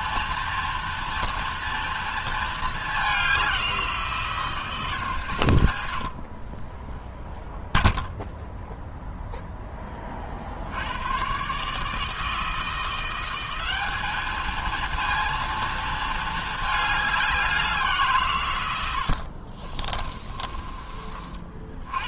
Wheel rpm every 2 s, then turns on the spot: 230, 210, 170, 10, 0, 90, 170, 230, 210, 100, 30.
18-20